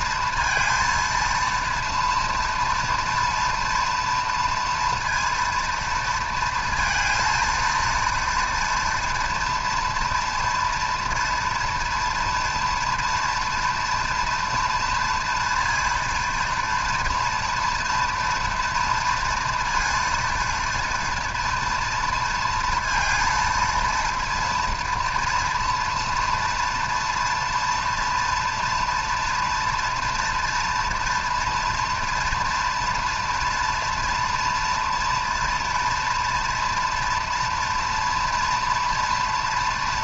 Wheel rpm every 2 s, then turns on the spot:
230, 230, 230, 230, 230, 230, 230, 230, 230, 230, 230, 230, 240, 230, 230, 230, 230, 230, 240, 230.
none